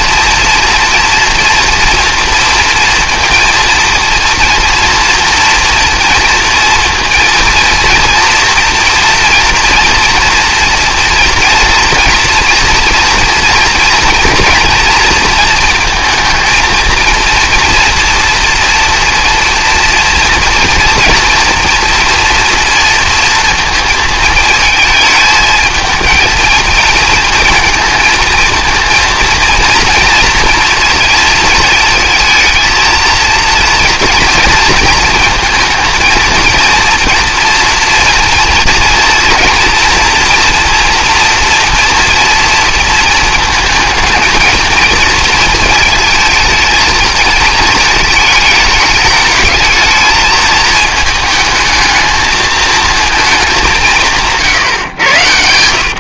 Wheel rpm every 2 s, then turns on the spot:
240, 230, 230, 230, 230, 240, 240, 230, 230, 230, 230, 230, 220, 230, 230, 230, 220, 220, 230, 230, 240, 230, 220, 230, 210, 220, 220, 130.
none